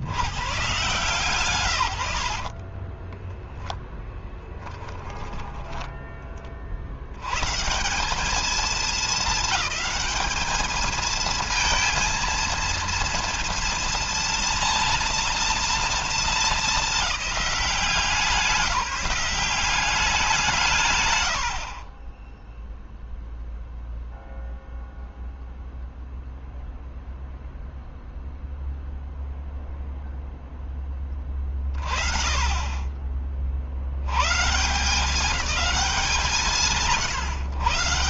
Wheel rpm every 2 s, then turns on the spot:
130, 30, 10, 70, 220, 220, 230, 230, 210, 180, 150, 0, 0, 0, 0, 20, 30, 160, 140.
2-4